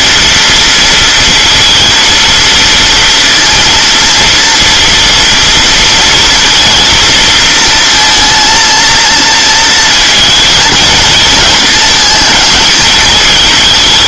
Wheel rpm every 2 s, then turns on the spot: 230, 230, 230, 230, 220, 230, 220.
none